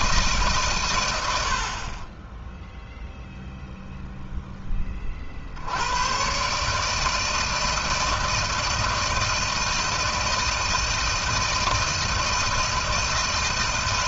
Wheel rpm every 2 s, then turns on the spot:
120, 0, 20, 150, 160, 160, 160.
none